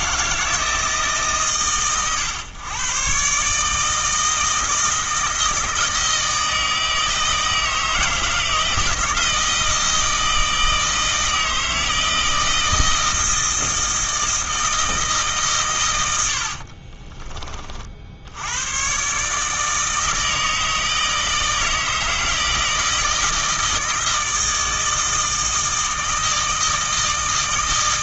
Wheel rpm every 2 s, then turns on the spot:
160, 110, 160, 160, 160, 160, 160, 160, 40, 110, 160, 160, 160, 160.
16-18